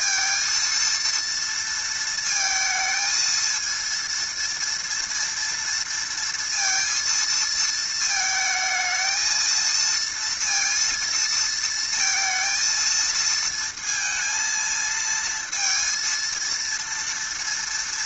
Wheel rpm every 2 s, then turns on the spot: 230, 230, 230, 230, 220, 230, 230, 230, 230.
none